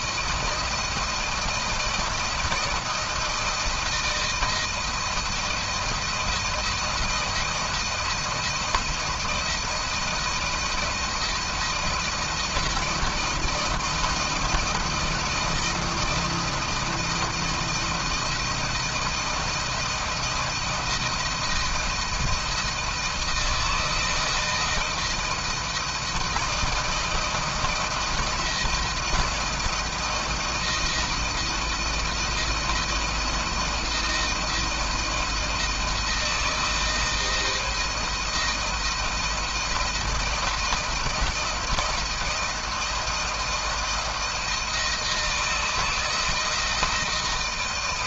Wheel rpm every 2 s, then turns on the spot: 170, 160, 170, 170, 160, 160, 160, 170, 170, 170, 170, 160, 160, 160, 160, 160, 160, 160, 160, 160, 160, 170, 160, 160.
none